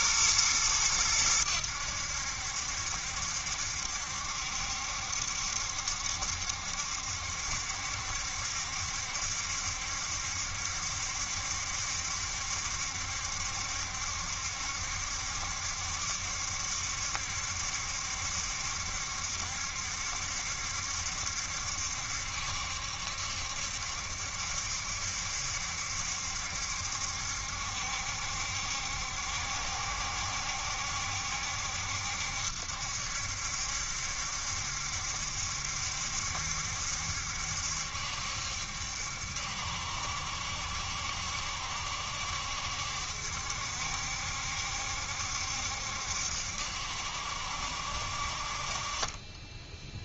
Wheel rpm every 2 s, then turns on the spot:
110, 70, 70, 70, 70, 70, 70, 70, 70, 70, 70, 70, 70, 70, 70, 70, 70, 70, 70, 70, 70, 70, 70, 70, 40.
none